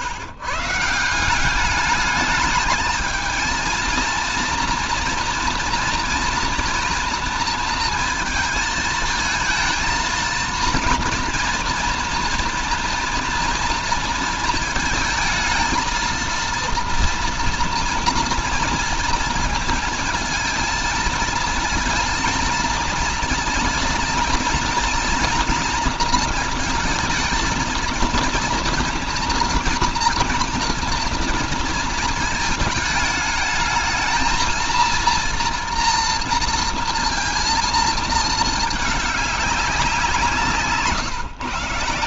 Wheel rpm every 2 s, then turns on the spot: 140, 220, 230, 230, 230, 230, 240, 230, 230, 230, 230, 230, 230, 220, 230, 230, 220, 230, 230, 220, 170.
none